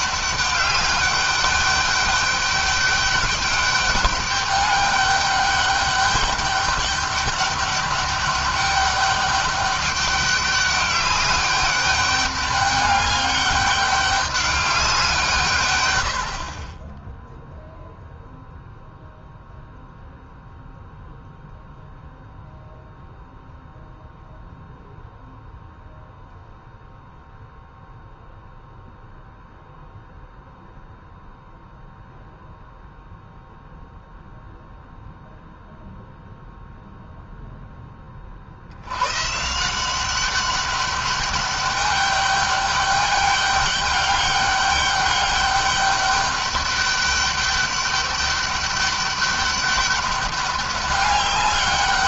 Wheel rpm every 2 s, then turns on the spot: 200, 200, 200, 200, 200, 200, 200, 180, 20, 0, 0, 0, 0, 0, 0, 0, 0, 0, 0, 100, 200, 200, 200, 200, 200, 200.
none